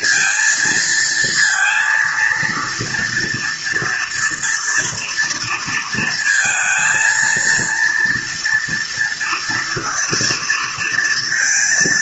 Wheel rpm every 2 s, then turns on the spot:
230, 230, 230, 230, 230, 230.
none